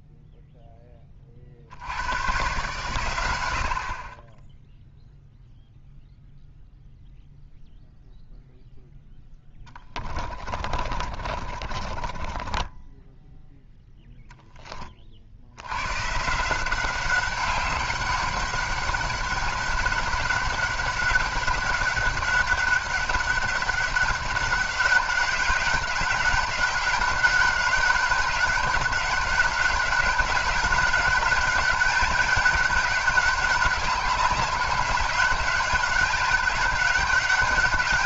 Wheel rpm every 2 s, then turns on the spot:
10, 110, 0, 0, 0, 30, 20, 10, 180, 200, 200, 200, 190, 200, 200, 200, 200, 200, 200.
10-14